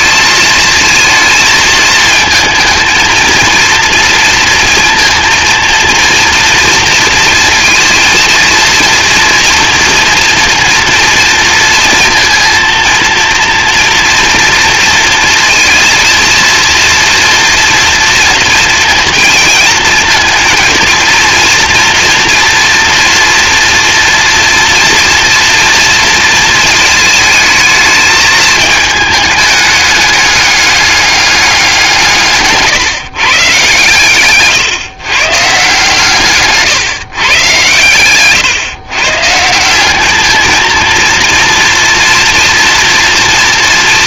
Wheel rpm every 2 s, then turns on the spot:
220, 220, 230, 230, 230, 230, 230, 230, 230, 230, 230, 230, 240, 230, 220, 210, 160, 130, 150, 120, 210, 230.
none